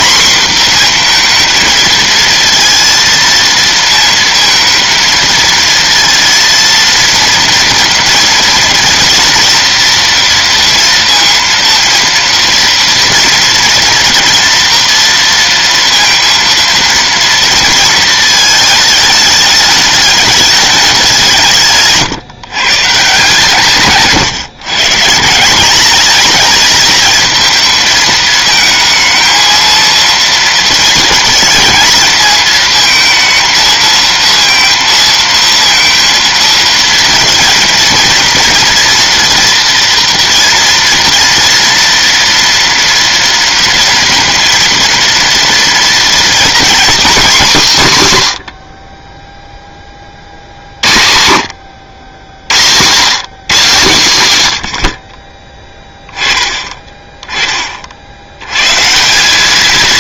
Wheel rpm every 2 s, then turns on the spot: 240, 230, 230, 230, 230, 230, 230, 230, 230, 220, 210, 140, 140, 220, 220, 230, 230, 230, 230, 230, 230, 230, 230, 250, 80, 60, 110, 100, 20, 110.
none